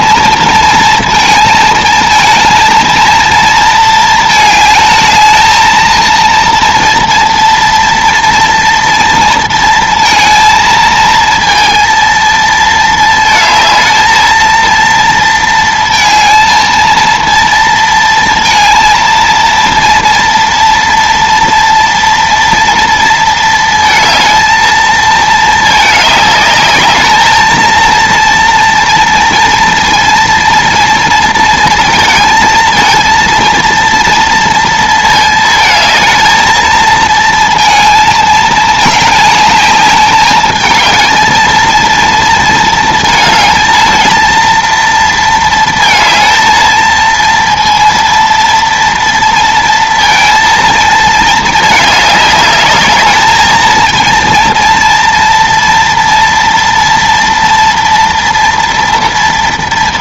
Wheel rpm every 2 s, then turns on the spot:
230, 230, 220, 230, 240, 230, 230, 230, 230, 230, 230, 230, 220, 210, 230, 230, 220, 230, 220, 220, 210, 230, 230, 230, 230, 230, 210, 230, 230, 230.
none